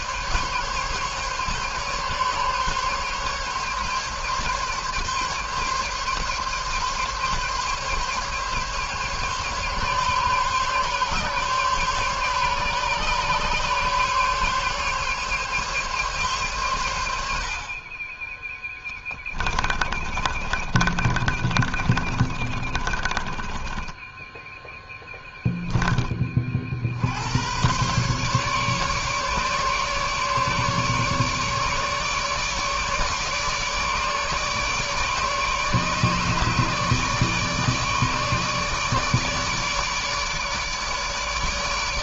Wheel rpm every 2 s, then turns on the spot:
140, 140, 140, 140, 140, 140, 140, 140, 90, 20, 30, 30, 10, 70, 140, 150, 150, 150, 150, 150, 150.
18-26